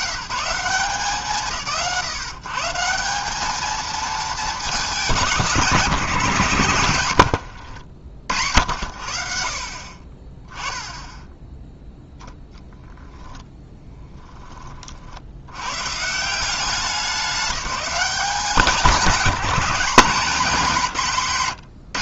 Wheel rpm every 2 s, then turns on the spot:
140, 160, 190, 140, 70, 10, 0, 20, 190, 190, 160.
6-8